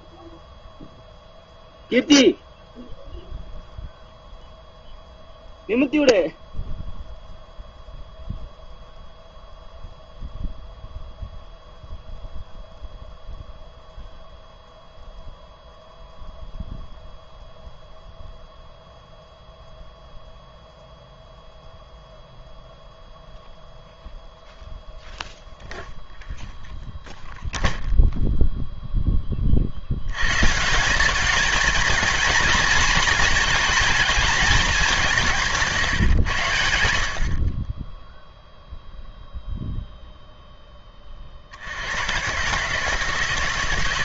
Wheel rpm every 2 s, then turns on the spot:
0, 0, 0, 0, 0, 0, 0, 0, 0, 0, 0, 0, 0, 0, 0, 150, 220, 210, 100, 0, 10, 140.
none